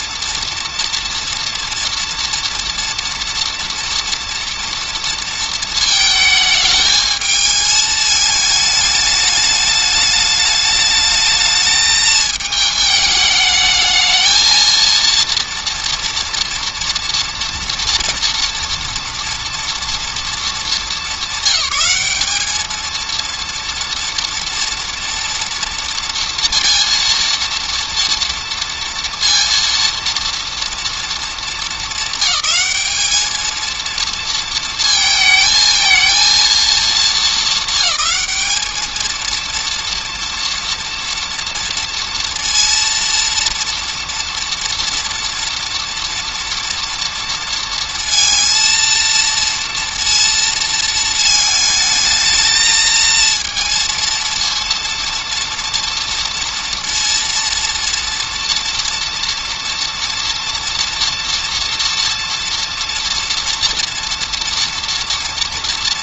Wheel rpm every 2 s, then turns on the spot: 230, 240, 230, 220, 210, 210, 210, 230, 230, 230, 220, 220, 230, 230, 230, 230, 200, 230, 220, 220, 230, 230, 230, 230, 230, 230, 220, 230, 230, 240, 230, 230, 230.
none